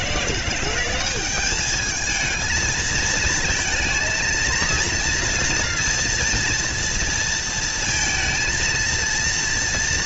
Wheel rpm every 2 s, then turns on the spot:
180, 220, 230, 230, 230.
none